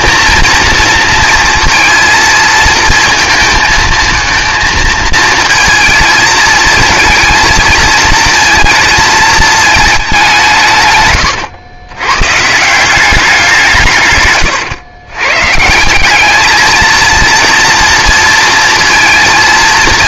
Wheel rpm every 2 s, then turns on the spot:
230, 220, 220, 220, 220, 160, 160, 120, 220, 230.
none